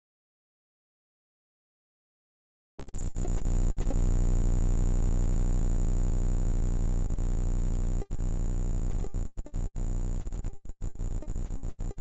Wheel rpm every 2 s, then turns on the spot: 0, 0, 0, 0, 0, 0.
none